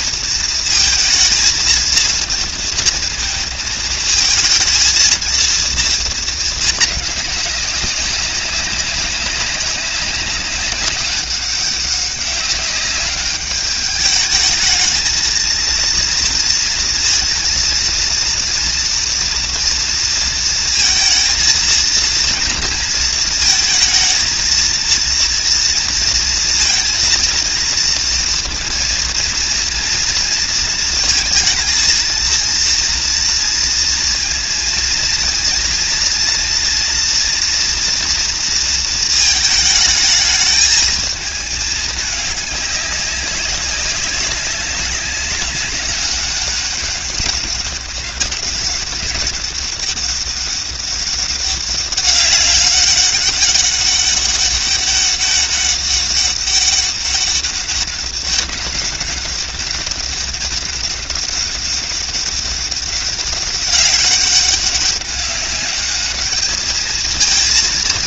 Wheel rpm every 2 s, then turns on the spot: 230, 230, 220, 210, 200, 190, 200, 220, 230, 230, 230, 230, 230, 230, 230, 230, 230, 230, 230, 220, 220, 200, 200, 200, 200, 200, 200, 200, 200, 200, 200, 200, 200, 220.
none